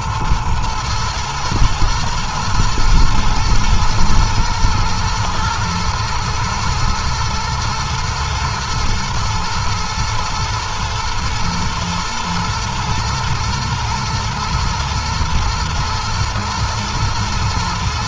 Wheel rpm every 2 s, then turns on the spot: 110, 110, 120, 110, 110, 110, 110, 110, 120.
none